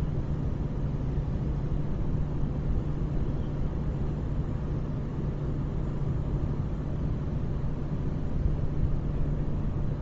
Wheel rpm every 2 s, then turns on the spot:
0, 0, 0, 0, 0.
none